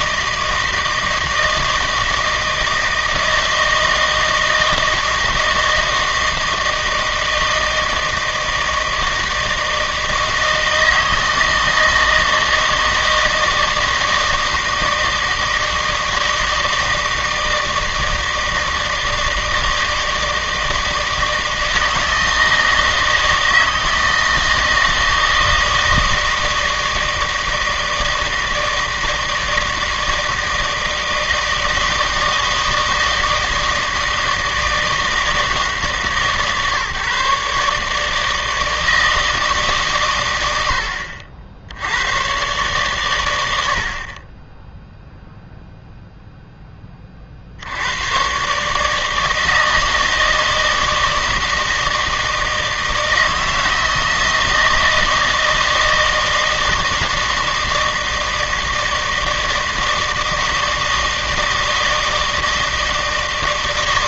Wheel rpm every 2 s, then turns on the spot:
160, 160, 160, 160, 160, 160, 160, 160, 160, 160, 160, 160, 160, 160, 160, 160, 160, 160, 140, 160, 80, 120, 10, 10, 140, 160, 160, 160, 160, 160, 160, 160.
none